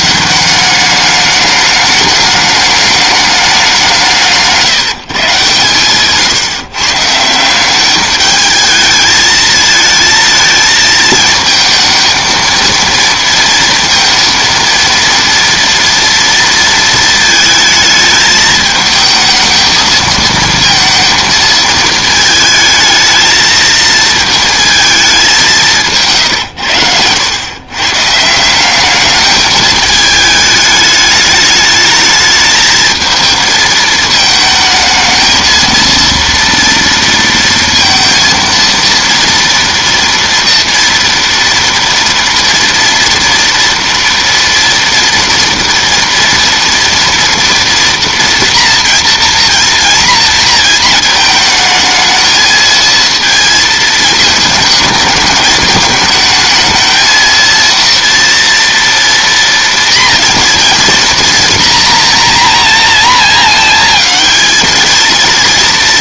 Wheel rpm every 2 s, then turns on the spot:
190, 210, 160, 130, 220, 220, 230, 230, 230, 220, 220, 220, 220, 100, 180, 210, 220, 220, 230, 230, 240, 230, 230, 230, 230, 230, 220, 220, 220, 230, 230, 240, 220.
none